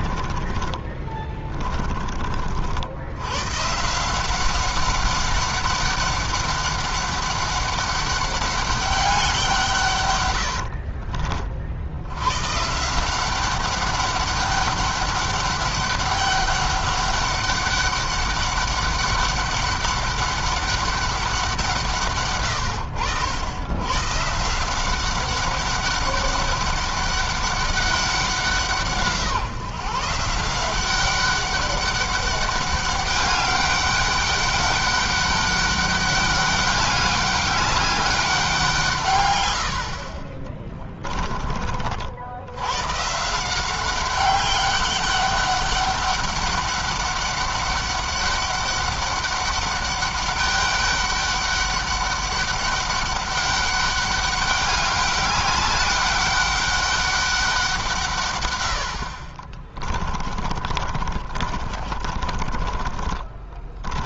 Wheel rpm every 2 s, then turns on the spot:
40, 70, 190, 200, 200, 80, 160, 200, 200, 200, 200, 100, 170, 200, 170, 180, 200, 200, 200, 160, 20, 110, 200, 200, 200, 200, 200, 200, 200, 90, 40, 20.
0-2 10-12 40-42 60-64